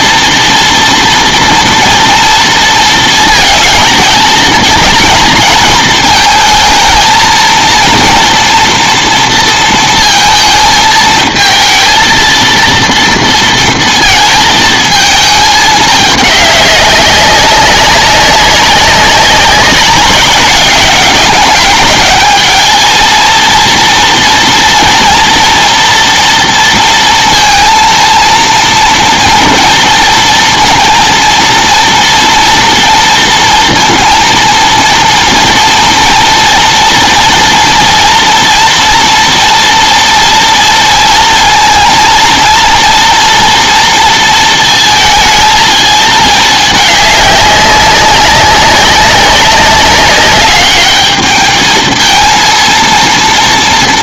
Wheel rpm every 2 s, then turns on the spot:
240, 230, 230, 220, 230, 220, 230, 220, 200, 190, 200, 220, 240, 230, 230, 230, 230, 230, 230, 230, 230, 230, 230, 210, 200, 200, 230.
none